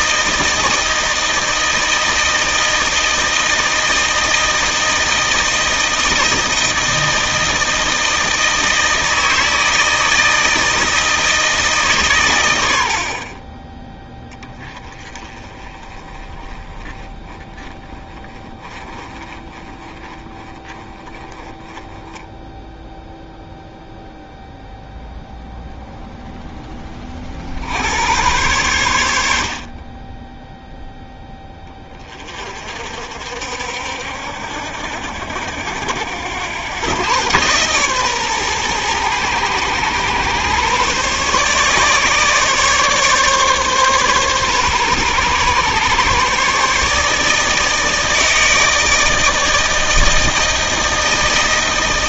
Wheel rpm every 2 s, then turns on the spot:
160, 160, 160, 160, 160, 160, 70, 20, 20, 30, 30, 0, 0, 20, 100, 0, 50, 70, 110, 120, 140, 140, 140, 150, 160, 160.
none